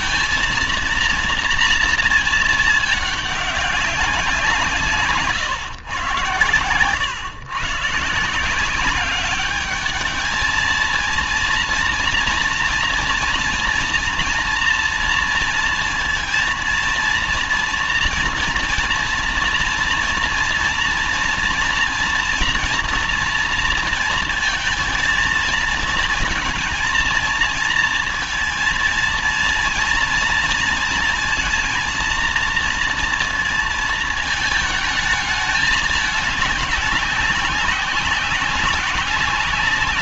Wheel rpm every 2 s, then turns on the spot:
230, 220, 160, 110, 180, 220, 240, 230, 230, 230, 240, 230, 230, 230, 230, 230, 230, 220, 210, 190.
none